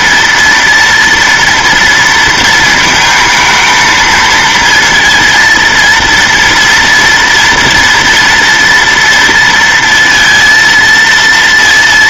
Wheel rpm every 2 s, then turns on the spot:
230, 220, 230, 230, 230, 230.
none